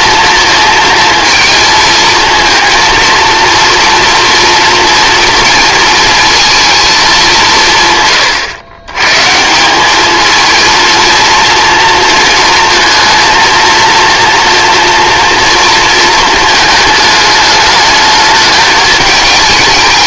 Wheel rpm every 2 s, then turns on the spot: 230, 230, 240, 220, 110, 230, 230, 240, 220, 220.
none